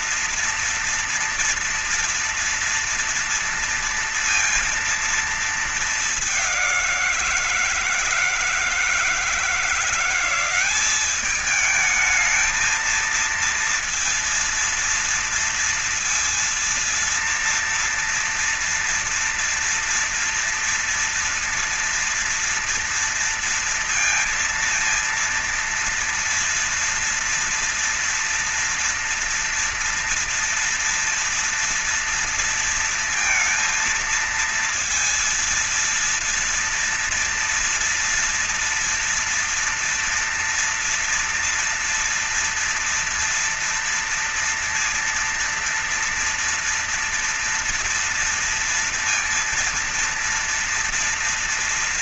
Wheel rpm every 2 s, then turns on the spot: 230, 230, 230, 190, 160, 190, 220, 230, 230, 230, 230, 230, 230, 230, 230, 230, 230, 230, 230, 230, 230, 230, 230, 230, 240, 230.
none